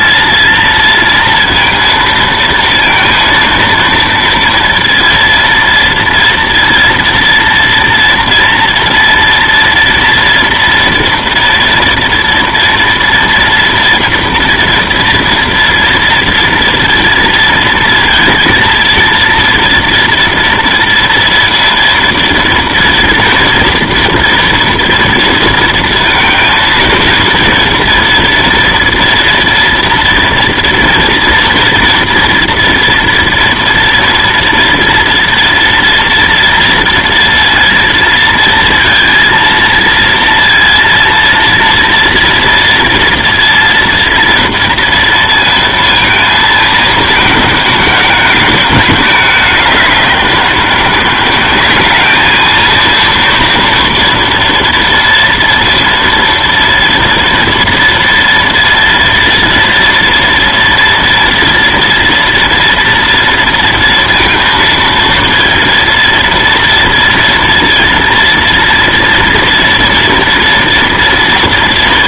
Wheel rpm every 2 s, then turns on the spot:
230, 230, 230, 230, 230, 230, 230, 230, 230, 230, 230, 230, 240, 230, 240, 240, 230, 230, 230, 230, 230, 230, 230, 220, 210, 180, 220, 230, 230, 230, 230, 230, 230, 230, 230, 230.
none